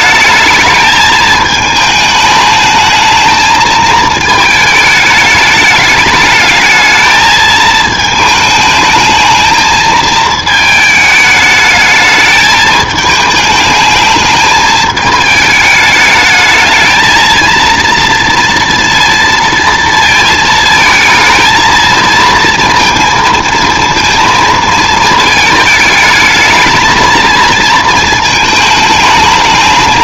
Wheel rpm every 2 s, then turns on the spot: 210, 220, 220, 220, 210, 210, 230, 230, 220, 230, 220, 230, 220, 220, 220.
none